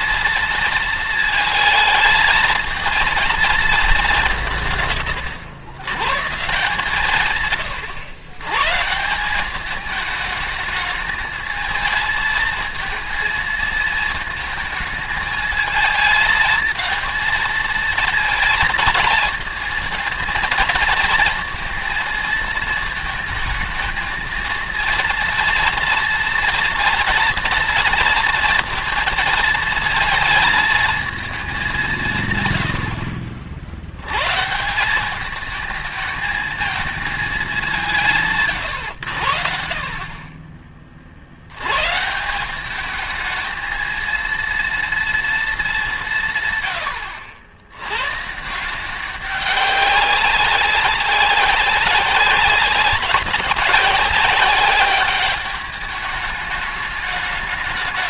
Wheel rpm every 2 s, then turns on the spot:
230, 220, 170, 150, 130, 220, 220, 220, 220, 220, 230, 230, 230, 230, 230, 220, 120, 160, 220, 140, 40, 190, 230, 130, 170, 190, 190, 200, 210.
32-34